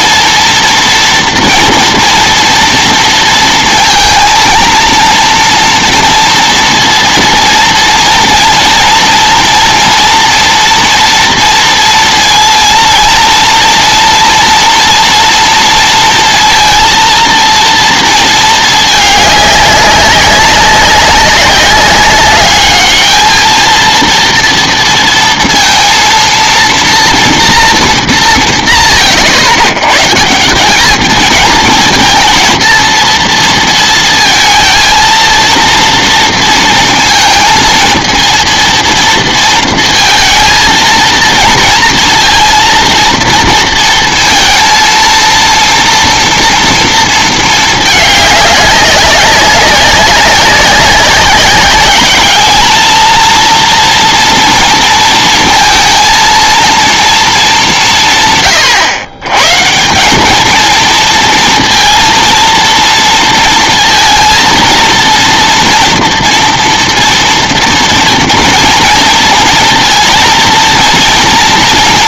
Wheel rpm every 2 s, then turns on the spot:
230, 230, 230, 230, 230, 230, 230, 230, 230, 220, 190, 200, 230, 230, 180, 180, 230, 230, 230, 230, 220, 230, 230, 230, 200, 190, 210, 230, 230, 130, 220, 230, 230, 230, 240, 230.
none